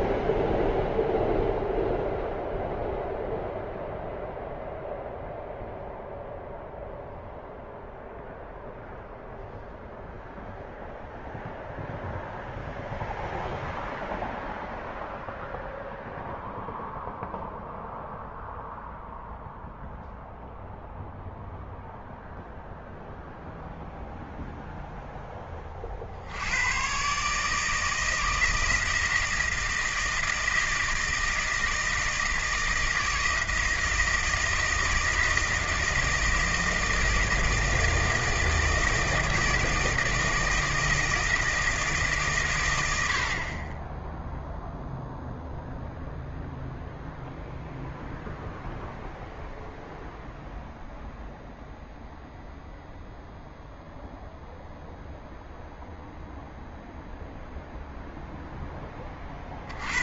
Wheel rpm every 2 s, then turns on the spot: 0, 0, 0, 0, 0, 0, 0, 0, 0, 0, 0, 0, 0, 100, 160, 160, 160, 160, 160, 160, 160, 110, 0, 0, 0, 0, 0, 0, 0, 0.
none